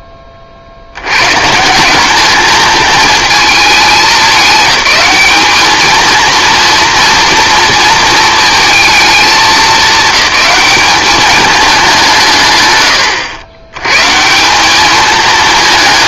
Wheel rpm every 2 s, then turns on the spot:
40, 220, 210, 230, 230, 210, 120, 220.
none